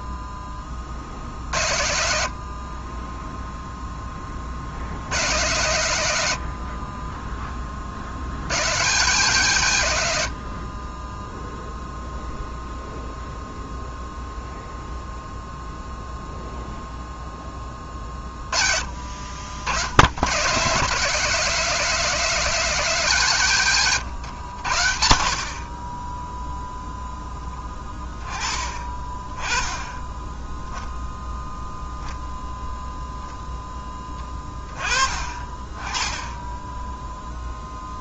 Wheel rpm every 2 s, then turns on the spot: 40, 20, 80, 30, 130, 30, 0, 0, 0, 40, 160, 170, 70, 10, 20, 0, 0, 30, 10.
none